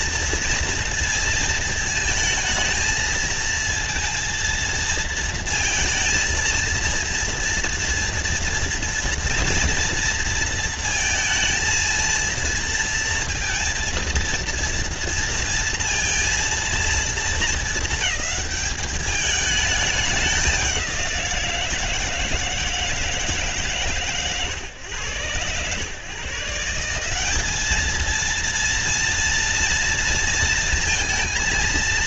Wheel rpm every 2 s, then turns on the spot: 230, 220, 230, 230, 240, 230, 230, 230, 230, 210, 190, 160, 110, 150, 230, 230.
none